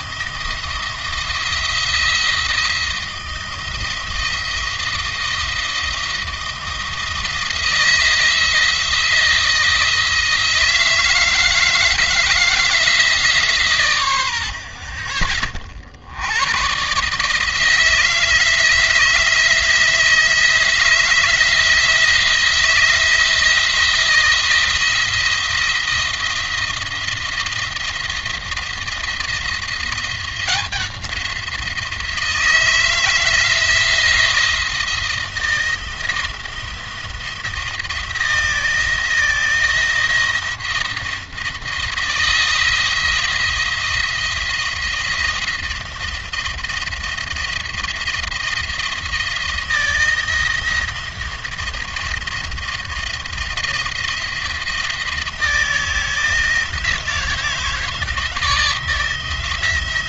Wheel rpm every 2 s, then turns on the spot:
170, 170, 170, 170, 170, 160, 160, 40, 130, 160, 170, 170, 170, 170, 170, 180, 160, 170, 170, 160, 170, 170, 170, 170, 160, 160, 170, 170, 160, 160.
none